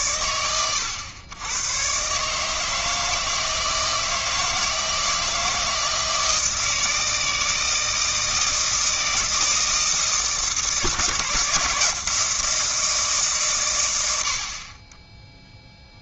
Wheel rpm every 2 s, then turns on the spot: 110, 150, 160, 160, 160, 160, 160, 30.
none